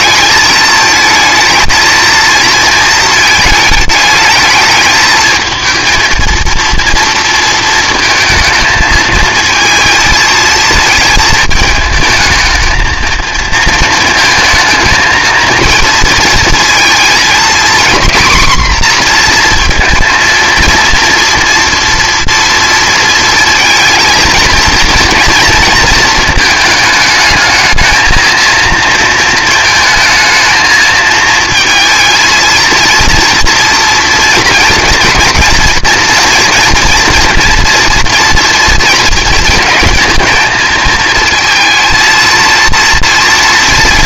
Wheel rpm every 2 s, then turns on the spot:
220, 230, 220, 230, 220, 220, 220, 220, 230, 250, 230, 230, 230, 220, 230, 220, 230, 230, 230, 230, 230, 230.
none